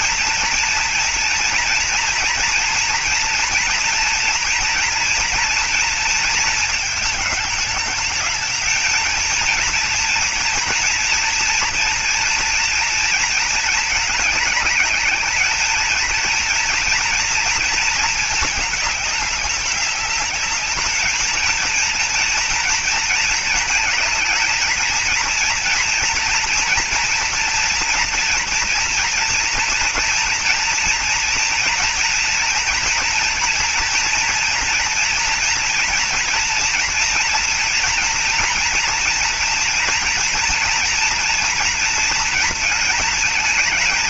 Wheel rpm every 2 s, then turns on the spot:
240, 230, 230, 230, 210, 230, 230, 210, 220, 220, 200, 230, 220, 230, 230, 230, 230, 240, 230, 230, 240, 230.
none